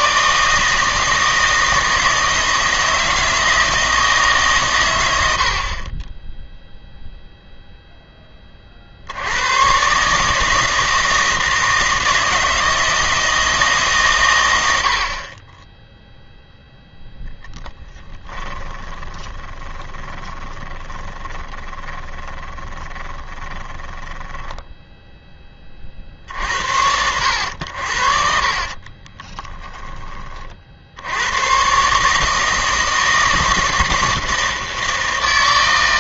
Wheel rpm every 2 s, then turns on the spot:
160, 160, 140, 0, 30, 160, 160, 90, 0, 20, 20, 20, 10, 70, 40, 50, 160, 160.
18-24 28-30